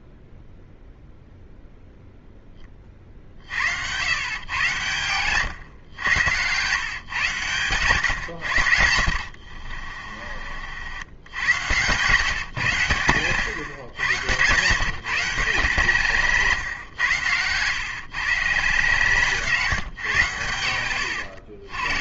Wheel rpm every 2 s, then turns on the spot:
0, 40, 110, 110, 60, 100, 100, 140, 100, 140, 70.
8-10 20-22